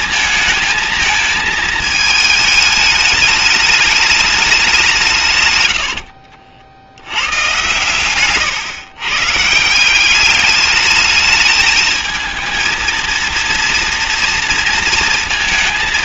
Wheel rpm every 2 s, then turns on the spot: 220, 210, 200, 60, 130, 210, 230, 230.
none